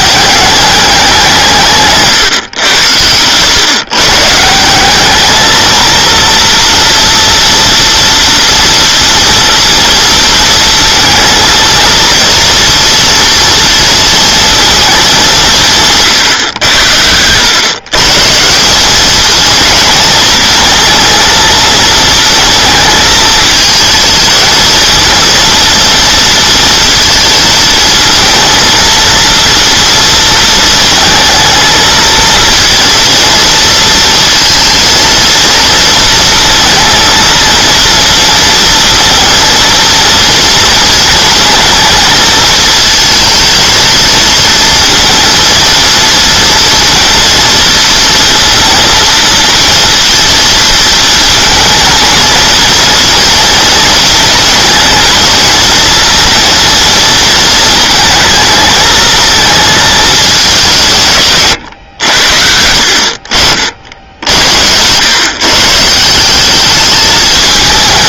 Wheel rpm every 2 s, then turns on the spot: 200, 100, 170, 230, 230, 230, 230, 220, 90, 190, 230, 230, 230, 230, 230, 230, 230, 230, 230, 230, 230, 220, 230, 230, 230, 230, 230, 220, 230, 220, 170, 60, 90, 210.
none